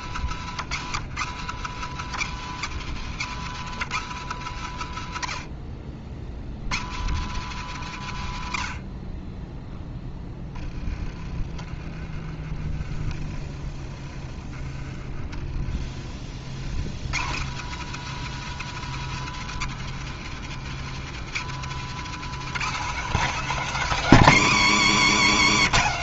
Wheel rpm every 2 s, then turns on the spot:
140, 160, 90, 130, 40, 20, 30, 30, 120, 160, 160, 230, 180.
24-26